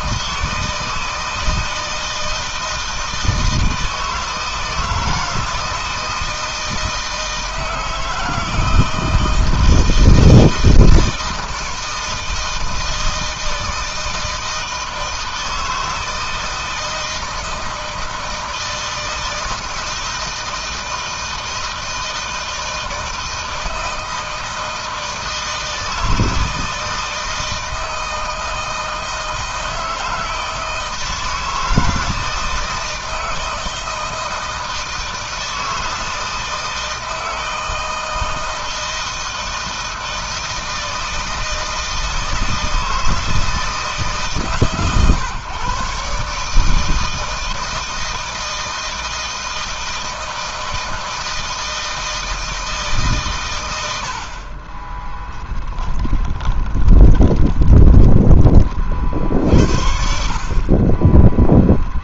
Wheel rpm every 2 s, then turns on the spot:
160, 160, 160, 160, 170, 170, 160, 160, 160, 160, 160, 160, 160, 160, 160, 160, 160, 160, 160, 160, 160, 160, 140, 160, 160, 160, 130, 10, 20, 50, 20.
54-58 60-62